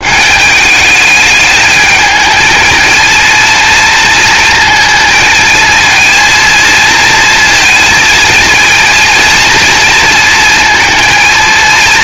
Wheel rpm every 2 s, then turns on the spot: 210, 220, 220, 230, 220, 220.
none